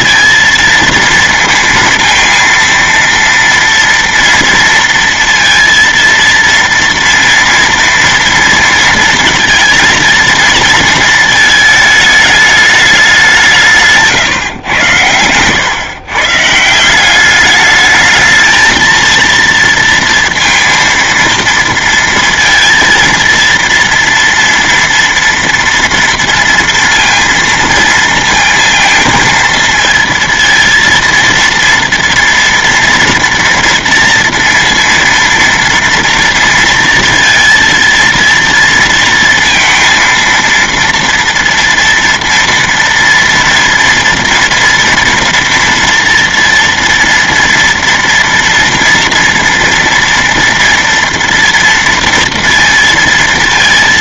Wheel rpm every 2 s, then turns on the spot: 230, 230, 230, 230, 230, 230, 210, 120, 160, 220, 230, 230, 230, 230, 230, 230, 230, 230, 230, 230, 230, 230, 230, 230, 230, 230, 230.
none